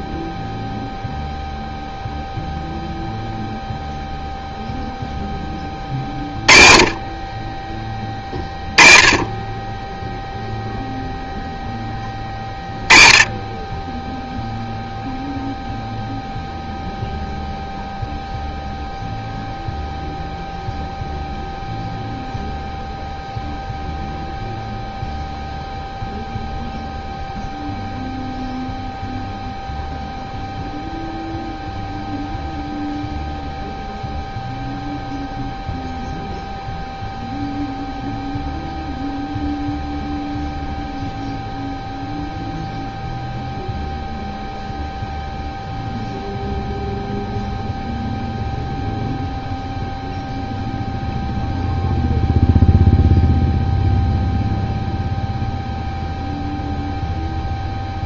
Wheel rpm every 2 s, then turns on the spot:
0, 0, 0, 40, 10, 0, 20, 0, 0, 0, 0, 0, 0, 0, 0, 0, 0, 0, 0, 0, 0, 0, 0, 0, 0, 0, 0, 0, 0.
none